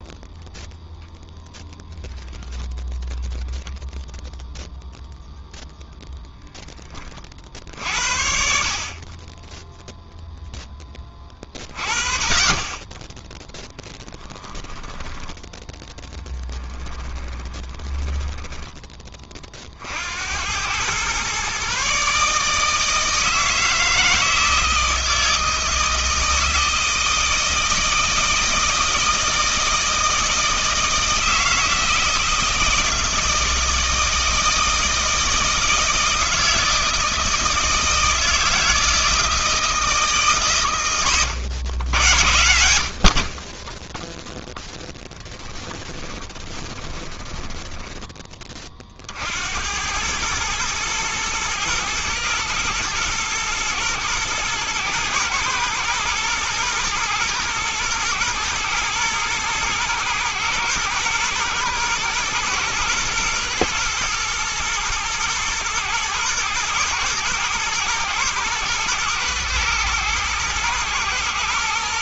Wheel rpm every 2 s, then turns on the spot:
0, 0, 0, 10, 50, 10, 20, 10, 20, 10, 100, 150, 160, 160, 160, 160, 160, 160, 160, 160, 130, 80, 10, 20, 30, 110, 110, 110, 120, 110, 120, 120, 110, 110, 120, 120.
16-18 44-48